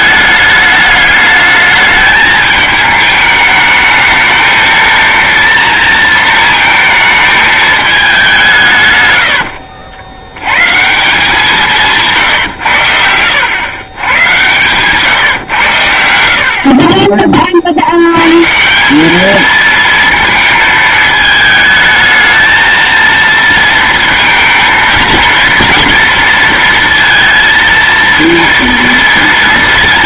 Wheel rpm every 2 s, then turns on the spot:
210, 210, 220, 220, 180, 110, 120, 120, 60, 140, 220, 220, 230, 230, 230.
14-16